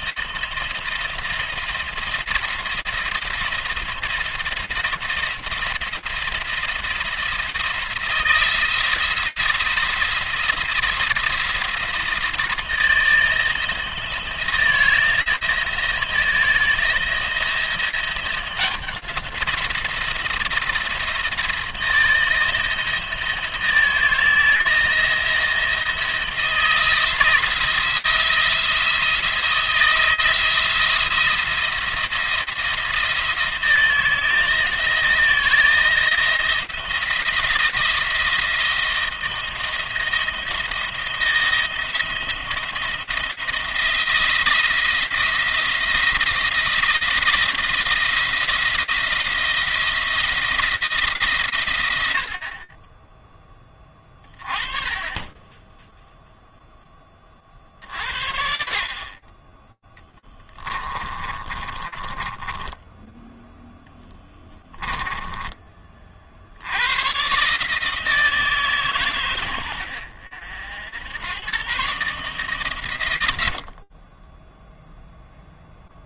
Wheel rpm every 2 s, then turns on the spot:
170, 170, 170, 170, 170, 170, 170, 170, 170, 180, 170, 160, 160, 160, 170, 170, 160, 160, 170, 170, 170, 160, 170, 170, 170, 160, 20, 20, 10, 40, 20, 10, 10, 100, 140, 80, 120, 0.
60-66